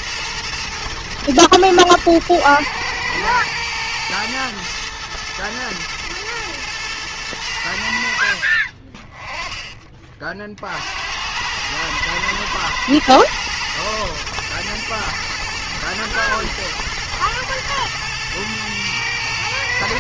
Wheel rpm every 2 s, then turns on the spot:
120, 110, 120, 110, 60, 60, 120, 120, 120, 110.
8-10